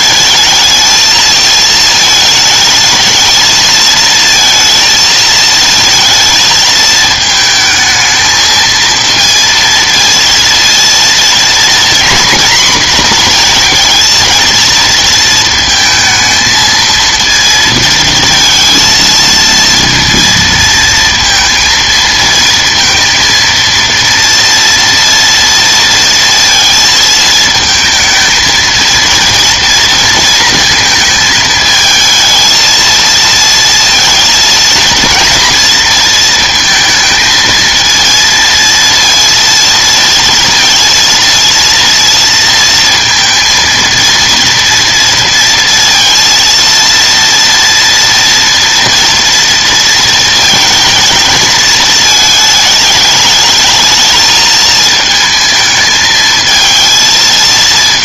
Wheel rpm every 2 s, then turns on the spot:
220, 220, 220, 220, 220, 230, 240, 230, 230, 230, 230, 230, 240, 230, 220, 220, 230, 230, 220, 230, 230, 230, 230, 230, 230, 220, 220, 220, 220.
none